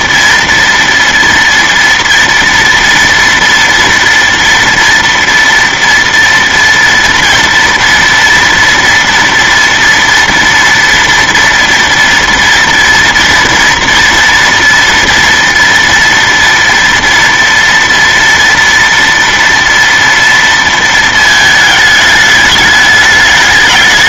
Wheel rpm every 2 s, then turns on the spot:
230, 240, 230, 230, 230, 230, 230, 230, 230, 230, 230, 210.
none